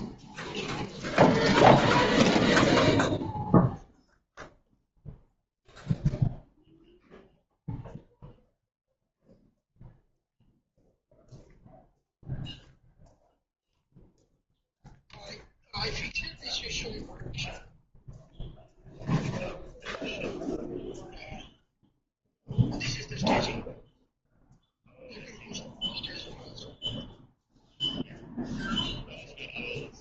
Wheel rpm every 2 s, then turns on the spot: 0, 0, 0, 0, 0, 0, 0, 0, 0, 0, 0, 0, 0, 0, 0.
none